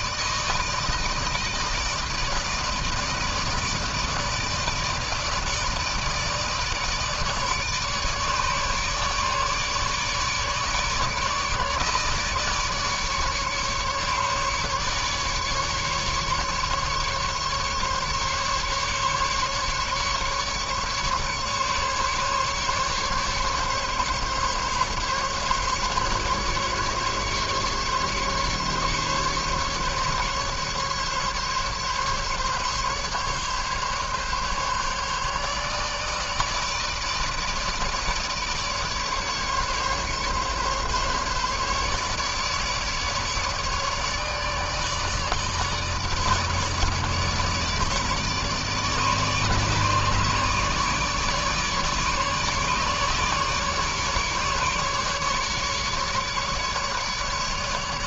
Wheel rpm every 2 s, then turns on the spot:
160, 160, 160, 160, 150, 150, 150, 150, 140, 140, 140, 140, 140, 140, 140, 140, 140, 140, 150, 150, 140, 150, 150, 150, 150, 150, 150, 150, 150.
none